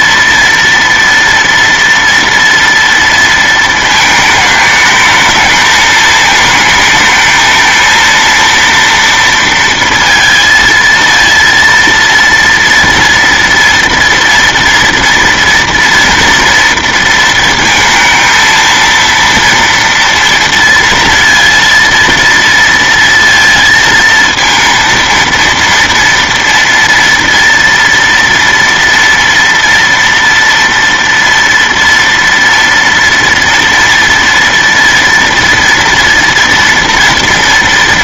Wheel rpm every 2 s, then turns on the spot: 230, 230, 220, 220, 230, 230, 230, 230, 230, 230, 230, 230, 230, 230, 230, 230, 230, 230, 230.
none